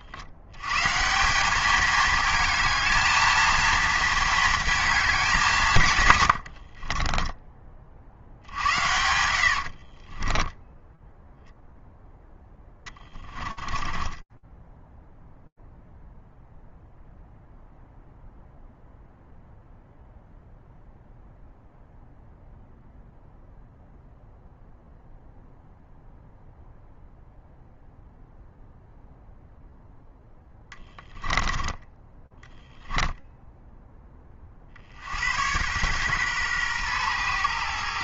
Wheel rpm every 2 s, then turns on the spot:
120, 230, 220, 70, 70, 10, 10, 10, 0, 0, 0, 0, 0, 0, 0, 20, 10, 50, 120.
6-14 30-34